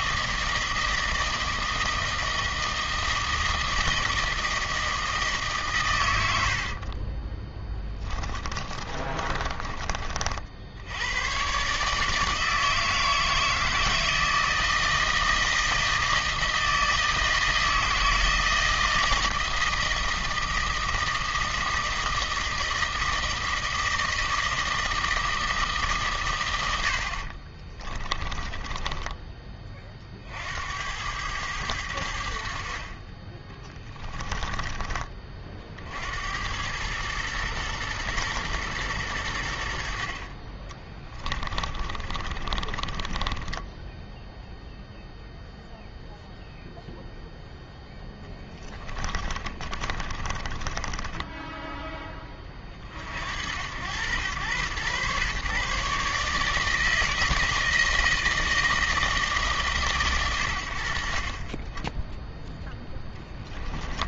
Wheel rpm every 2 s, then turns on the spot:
160, 160, 160, 60, 30, 60, 160, 160, 160, 160, 160, 160, 160, 100, 20, 80, 60, 20, 90, 110, 20, 30, 0, 0, 20, 20, 40, 110, 160, 160, 100, 0.
6-10 28-30 34-36 40-44 48-52